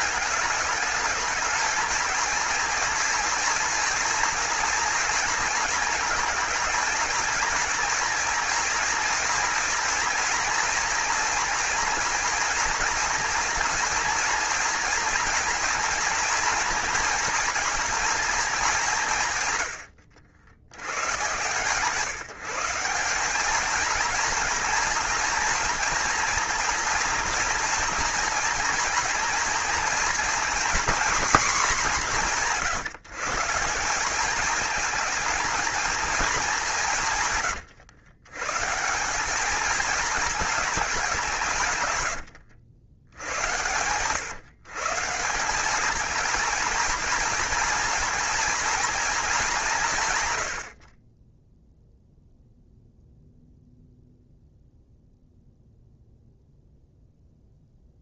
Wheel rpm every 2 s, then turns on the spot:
220, 230, 230, 220, 230, 230, 230, 230, 240, 190, 100, 180, 230, 230, 230, 240, 150, 210, 160, 170, 200, 80, 140, 230, 230, 60, 0, 0, 0.
none